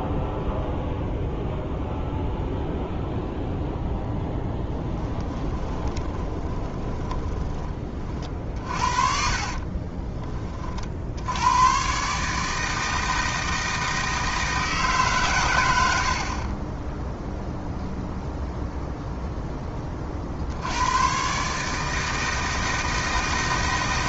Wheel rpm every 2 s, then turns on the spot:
0, 0, 20, 20, 40, 40, 160, 160, 10, 0, 100, 160.
4-10